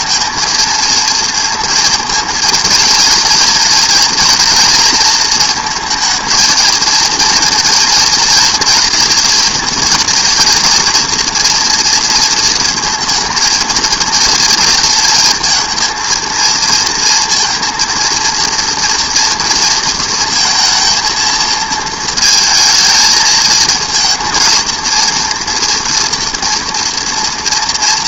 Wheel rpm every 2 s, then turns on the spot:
230, 230, 230, 230, 230, 230, 230, 230, 230, 230, 220, 220, 230, 230.
none